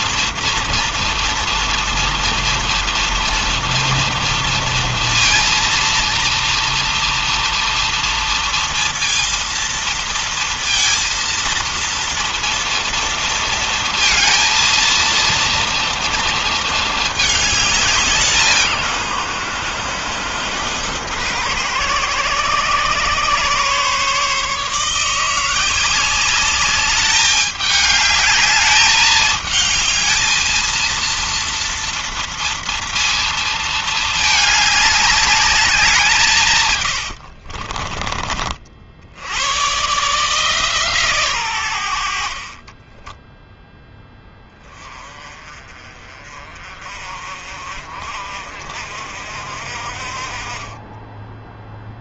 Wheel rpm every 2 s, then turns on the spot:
230, 230, 230, 230, 230, 230, 230, 230, 220, 130, 110, 130, 160, 200, 210, 230, 230, 200, 70, 80, 140, 10, 30, 40, 50, 10.
36-38 42-44